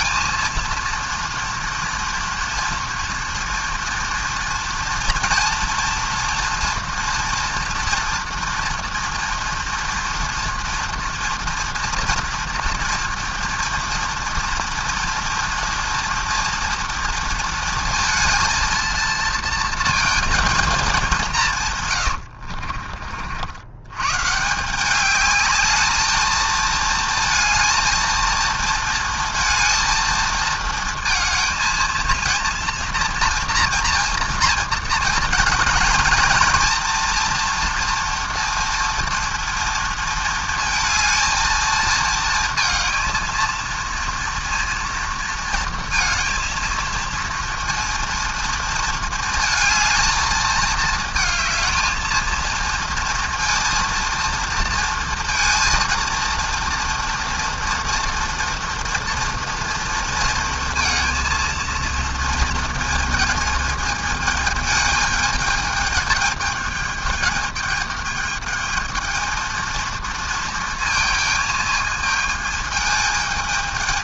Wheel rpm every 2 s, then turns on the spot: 230, 240, 240, 230, 240, 230, 230, 230, 230, 230, 220, 50, 180, 230, 230, 230, 230, 230, 230, 230, 220, 230, 230, 230, 230, 220, 230, 230, 230, 240, 230, 230, 220, 210, 220, 230, 220.
22-24